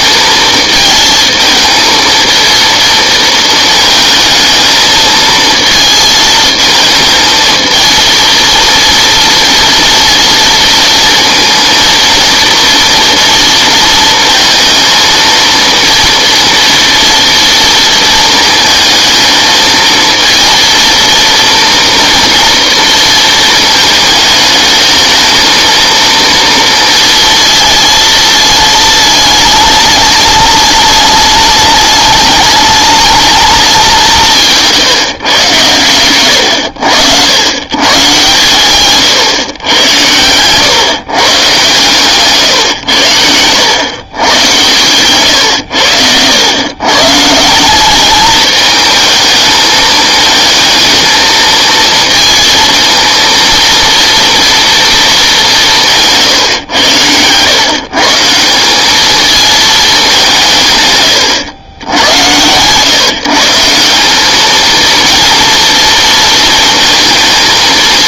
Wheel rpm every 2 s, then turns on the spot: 220, 230, 220, 220, 230, 230, 230, 230, 230, 230, 230, 230, 220, 230, 220, 210, 210, 150, 100, 130, 120, 120, 120, 120, 220, 220, 230, 230, 120, 190, 160, 110, 220, 220.
none